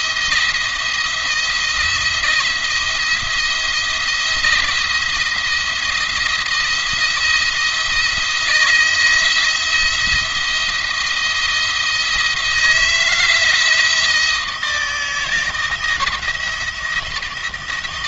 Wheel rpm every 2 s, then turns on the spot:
170, 170, 170, 170, 170, 170, 160, 160, 160.
none